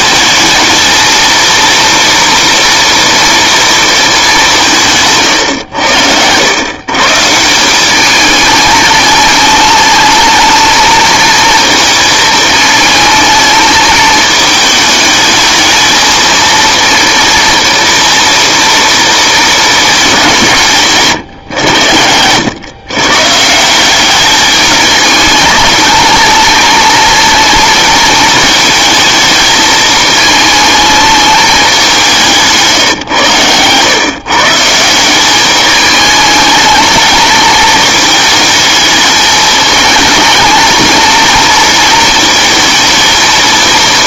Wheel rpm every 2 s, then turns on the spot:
220, 230, 190, 120, 210, 220, 220, 220, 230, 230, 160, 120, 210, 230, 220, 220, 160, 160, 210, 220, 220, 230.
none